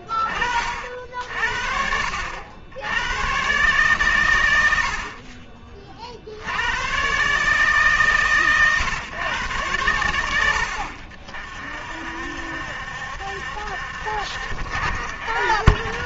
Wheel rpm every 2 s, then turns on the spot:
60, 120, 50, 140, 100, 40, 70, 40.
none